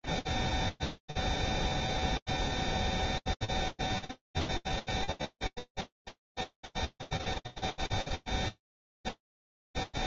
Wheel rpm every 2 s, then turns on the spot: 0, 0, 0, 0, 0.
none